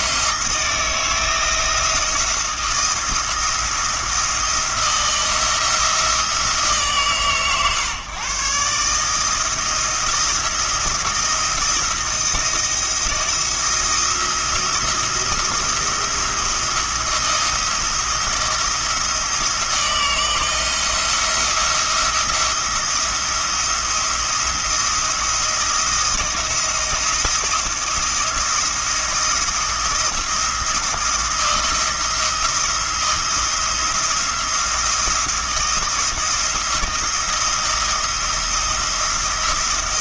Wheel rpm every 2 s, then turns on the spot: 160, 160, 170, 160, 150, 170, 160, 170, 170, 170, 170, 170, 170, 170, 170, 170, 170, 170, 160, 170.
none